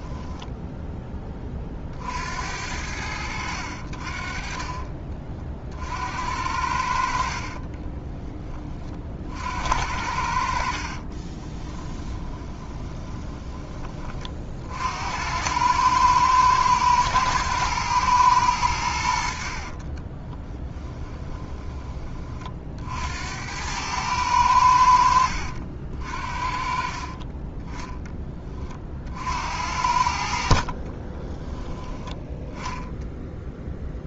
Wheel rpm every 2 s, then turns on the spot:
10, 80, 40, 60, 40, 40, 20, 70, 110, 80, 20, 60, 80, 40, 50, 30, 0.
4-6 10-14 20-22 30-32